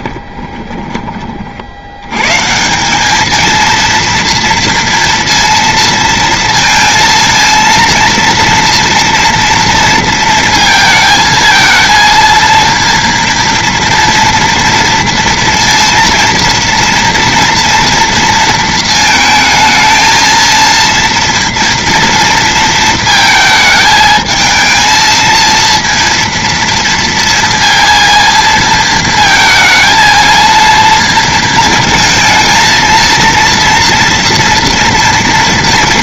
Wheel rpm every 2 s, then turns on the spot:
20, 170, 230, 230, 230, 220, 230, 230, 230, 230, 230, 230, 220, 230, 230, 230, 230, 230.
0-2